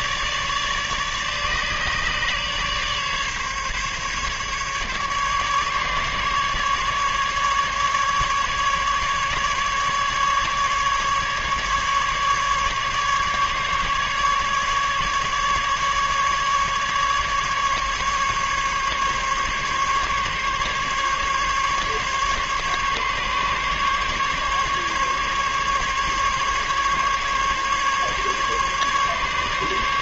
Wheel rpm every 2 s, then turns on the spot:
150, 140, 150, 150, 150, 140, 140, 150, 150, 140, 140, 140, 140, 140, 140.
none